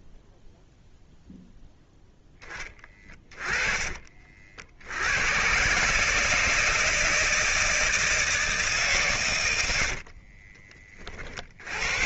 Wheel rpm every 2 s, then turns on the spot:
0, 30, 70, 160, 150, 30.
none